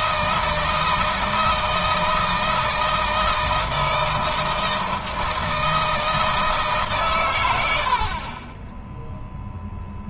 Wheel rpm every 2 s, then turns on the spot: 160, 160, 160, 140, 10.
none